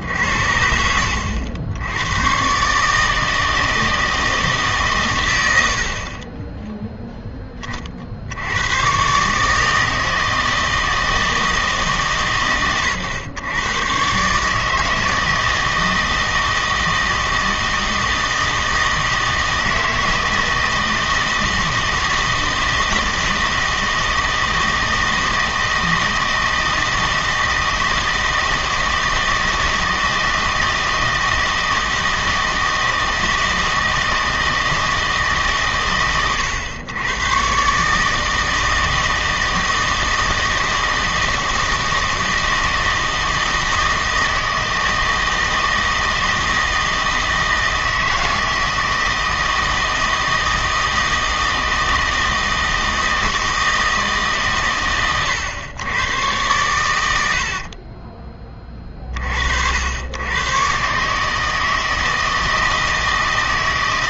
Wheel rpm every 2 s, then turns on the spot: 80, 140, 150, 10, 110, 160, 120, 160, 160, 160, 160, 160, 160, 160, 170, 160, 160, 160, 100, 160, 160, 160, 160, 160, 160, 160, 160, 130, 110, 30, 130, 160.
none